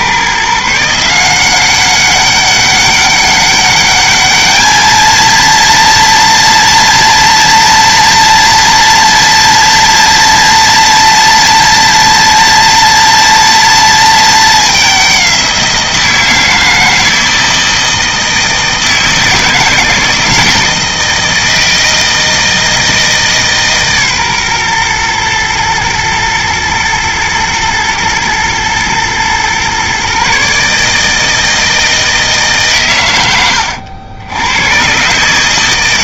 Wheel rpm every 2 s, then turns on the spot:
160, 200, 220, 230, 230, 230, 230, 200, 160, 160, 160, 160, 120, 120, 110, 150, 130, 120.
none